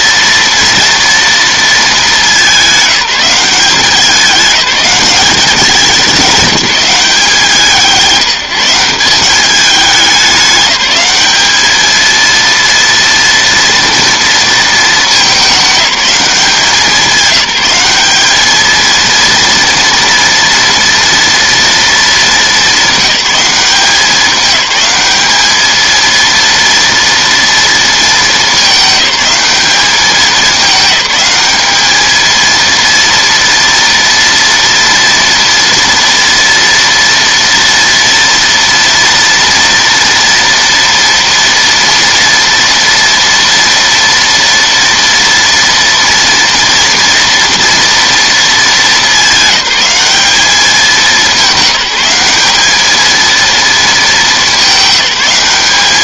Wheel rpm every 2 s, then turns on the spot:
230, 210, 200, 180, 180, 190, 230, 210, 190, 230, 230, 210, 200, 230, 210, 210, 230, 230, 230, 230, 230, 230, 230, 240, 210, 200, 220, 190.
none